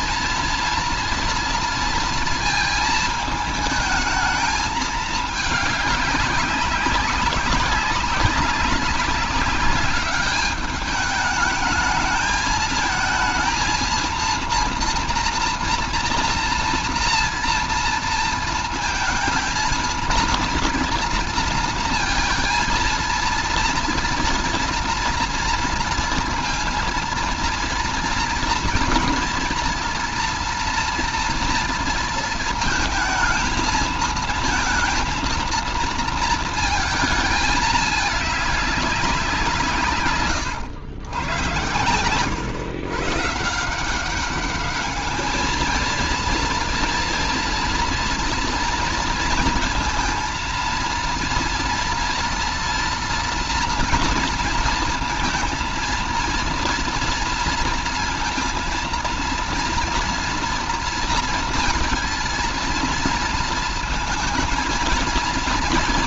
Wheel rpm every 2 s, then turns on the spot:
230, 220, 220, 190, 200, 200, 220, 230, 230, 230, 230, 230, 230, 230, 240, 240, 230, 230, 230, 200, 120, 130, 210, 230, 240, 230, 230, 230, 230, 230, 230, 230, 230.
none